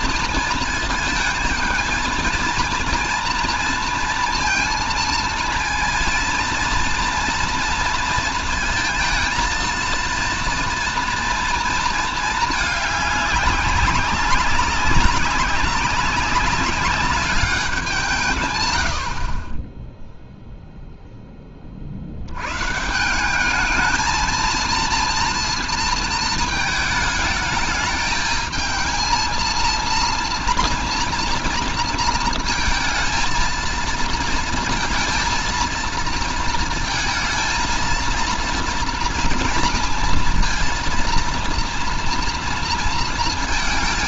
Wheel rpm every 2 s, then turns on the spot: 220, 230, 230, 230, 230, 230, 210, 200, 200, 100, 0, 140, 230, 220, 220, 230, 230, 230, 220, 230, 230, 230.
none